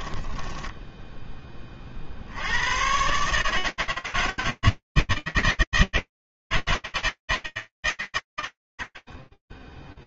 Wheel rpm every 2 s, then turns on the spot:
10, 50, 160, 160, 120.
0-2